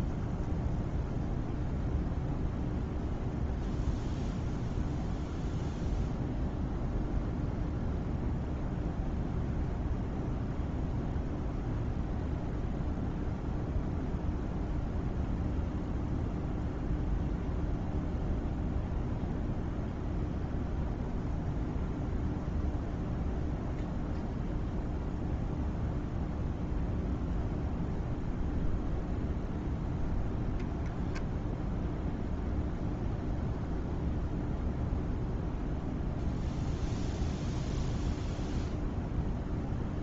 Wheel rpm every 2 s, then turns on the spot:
0, 0, 0, 0, 0, 0, 0, 0, 0, 0, 0, 0, 0, 0, 0, 0, 0, 0, 0, 0.
none